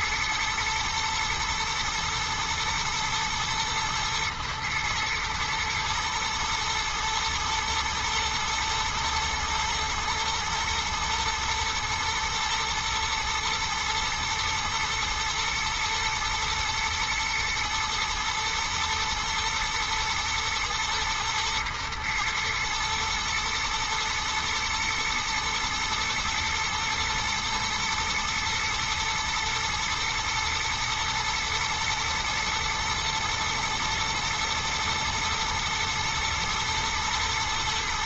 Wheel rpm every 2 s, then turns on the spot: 110, 110, 120, 110, 120, 120, 120, 120, 110, 120, 110, 110, 120, 110, 120, 110, 120, 110, 110.
none